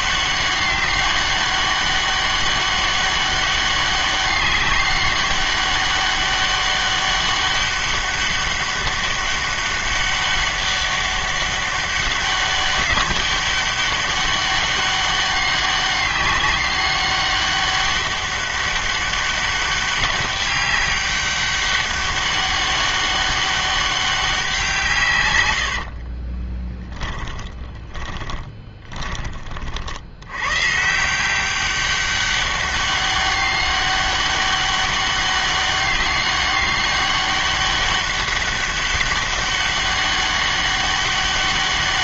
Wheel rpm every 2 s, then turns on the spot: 200, 200, 200, 200, 200, 200, 200, 200, 200, 200, 200, 200, 170, 20, 30, 120, 200, 200, 200, 200, 200.
26-30